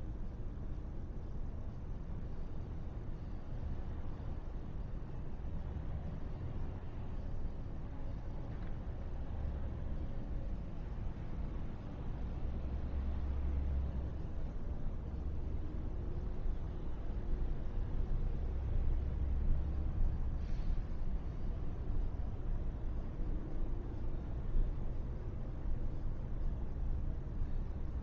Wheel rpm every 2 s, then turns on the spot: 0, 0, 0, 0, 0, 0, 0, 0, 0, 0, 0, 0, 0, 0.
none